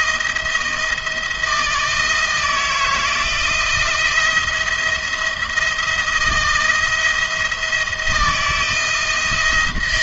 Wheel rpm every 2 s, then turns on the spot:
170, 160, 170, 170, 160.
none